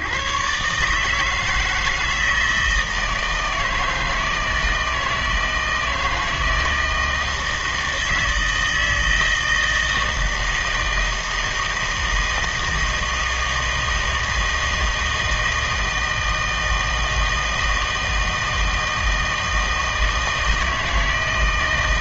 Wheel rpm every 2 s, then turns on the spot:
130, 160, 160, 160, 160, 160, 160, 160, 160, 160, 160.
none